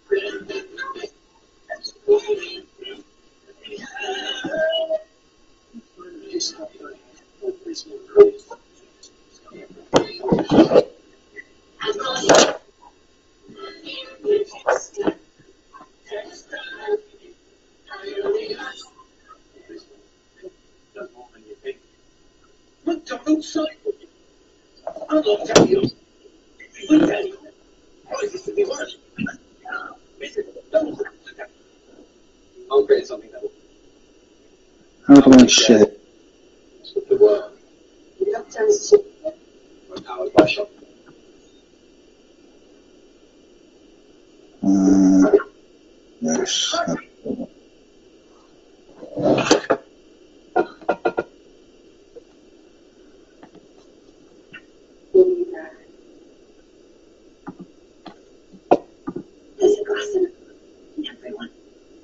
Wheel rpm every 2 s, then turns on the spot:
0, 0, 0, 0, 0, 0, 0, 0, 0, 0, 0, 0, 0, 0, 0, 0, 0, 0, 0, 0, 0, 0, 0, 0, 0, 0, 0, 0, 0, 0, 0.
none